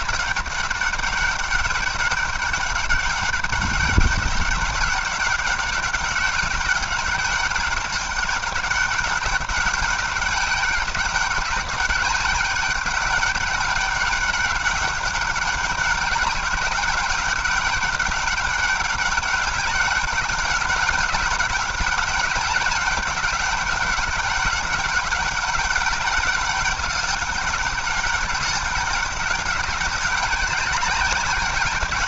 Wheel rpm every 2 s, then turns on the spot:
200, 200, 190, 200, 200, 190, 200, 190, 190, 200, 200, 190, 200, 200, 200, 190.
none